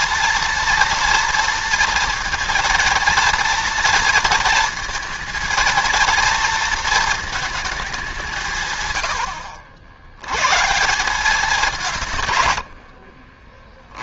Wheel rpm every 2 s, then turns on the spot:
230, 230, 230, 230, 140, 120, 90.
none